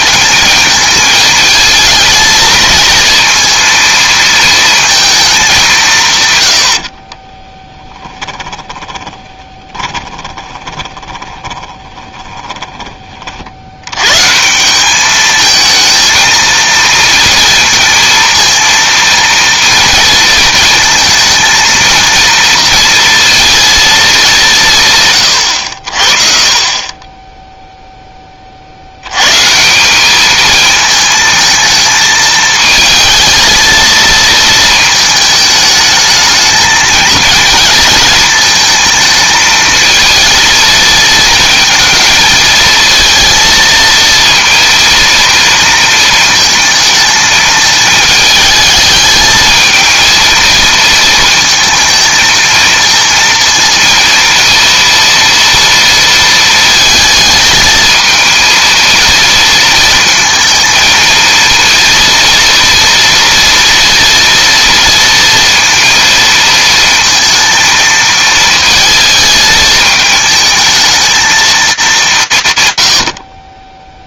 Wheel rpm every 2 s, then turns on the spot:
220, 220, 230, 70, 10, 20, 20, 180, 230, 230, 220, 230, 160, 30, 60, 220, 220, 220, 220, 220, 230, 220, 230, 220, 210, 230, 230, 230, 220, 230, 220, 230, 230, 230, 230, 220, 110.
6-12